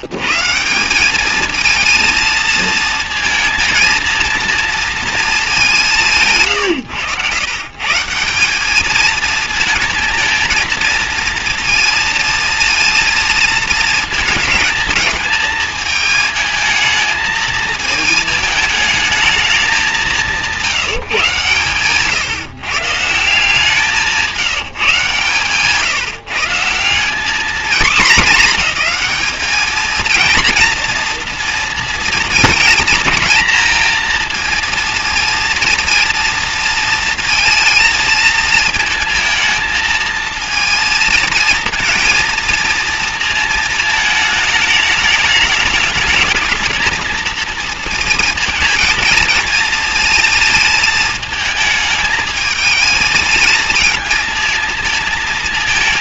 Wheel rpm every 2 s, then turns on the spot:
130, 230, 230, 160, 180, 230, 230, 220, 220, 220, 170, 150, 180, 160, 200, 240, 220, 230, 230, 220, 230, 230, 210, 220, 230, 220, 220, 220.
6-8